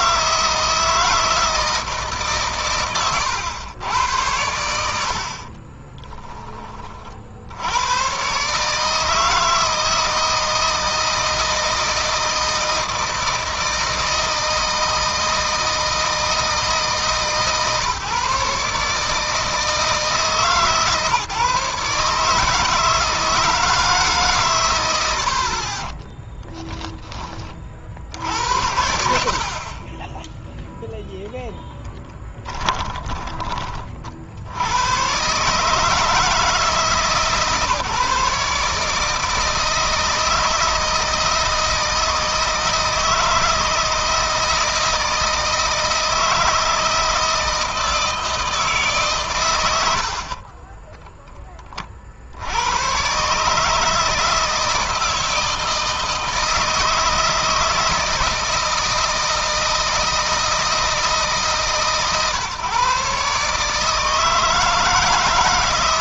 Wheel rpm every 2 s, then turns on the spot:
160, 120, 80, 40, 150, 160, 160, 160, 160, 150, 140, 150, 90, 10, 80, 0, 20, 100, 150, 150, 160, 160, 160, 160, 150, 20, 110, 160, 160, 160, 160, 140, 160.
4-6 32-34 50-52